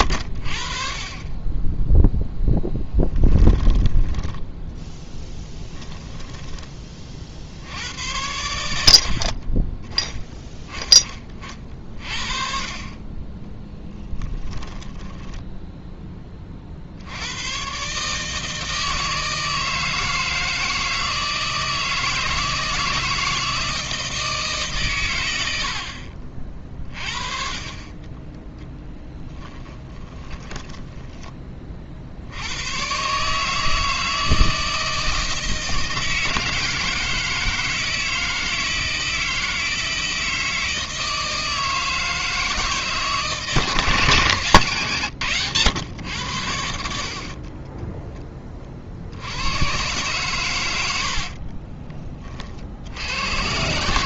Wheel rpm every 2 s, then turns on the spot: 30, 10, 10, 60, 30, 30, 30, 10, 80, 160, 160, 160, 120, 30, 20, 10, 140, 160, 160, 160, 160, 160, 120, 70, 50, 90, 60.
2-6 14-16 28-30 50-52